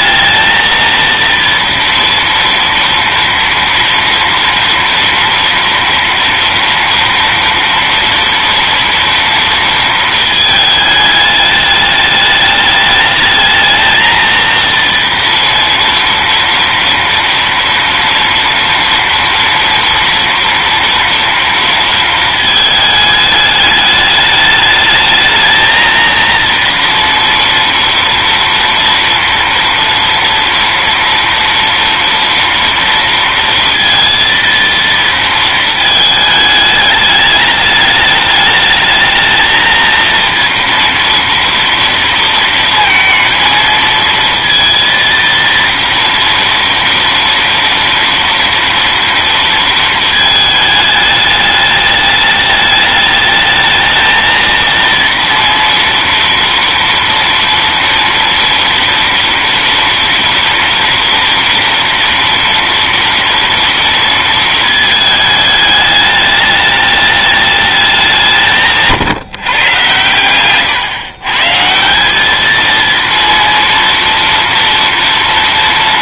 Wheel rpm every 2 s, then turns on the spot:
230, 230, 230, 230, 230, 220, 210, 230, 230, 230, 230, 220, 210, 240, 230, 240, 230, 230, 210, 220, 230, 230, 230, 230, 230, 210, 210, 230, 230, 230, 230, 230, 220, 210, 160, 130, 230, 230.
none